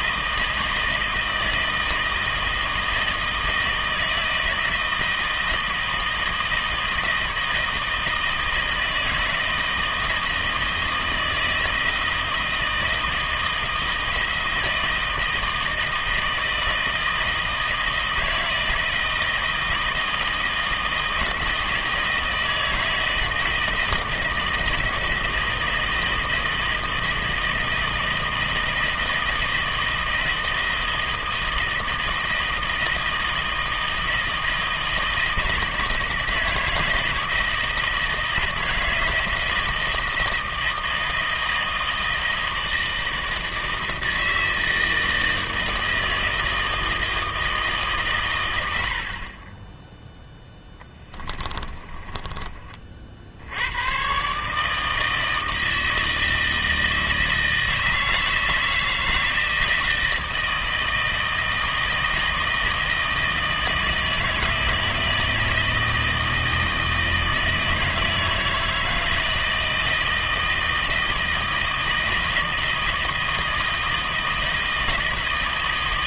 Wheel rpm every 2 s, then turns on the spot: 160, 160, 160, 160, 160, 160, 160, 160, 160, 160, 160, 160, 160, 160, 160, 160, 160, 160, 160, 160, 160, 160, 160, 160, 80, 10, 30, 150, 160, 160, 160, 160, 160, 160, 160, 160, 160, 160.
50-52